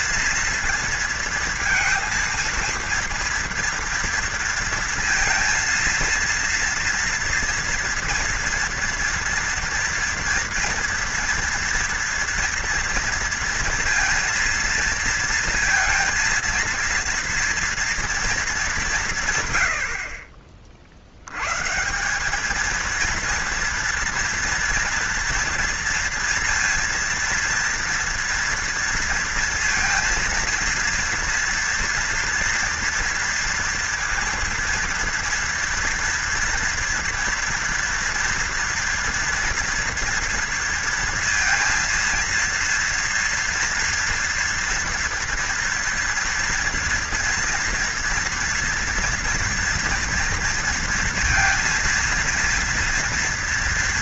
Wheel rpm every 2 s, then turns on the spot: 230, 230, 230, 230, 230, 230, 230, 230, 230, 190, 40, 210, 230, 230, 230, 230, 230, 230, 230, 230, 230, 230, 230, 230, 230, 230, 230.
none